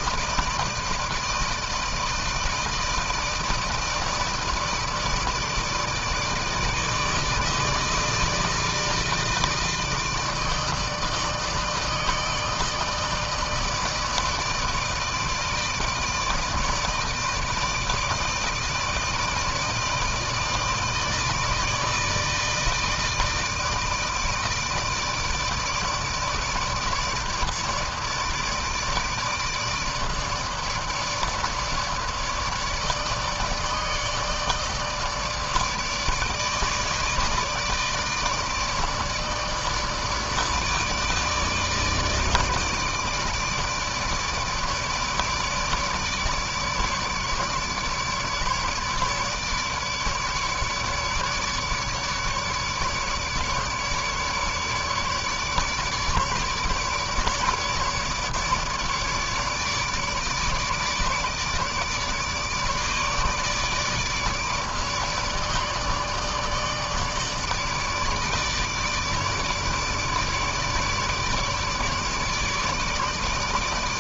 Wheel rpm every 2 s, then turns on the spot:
160, 160, 160, 160, 160, 160, 160, 160, 160, 160, 160, 160, 160, 160, 160, 160, 150, 160, 160, 160, 160, 150, 160, 150, 150, 150, 150, 150, 150, 150, 150, 150, 150, 150, 150, 150, 150.
none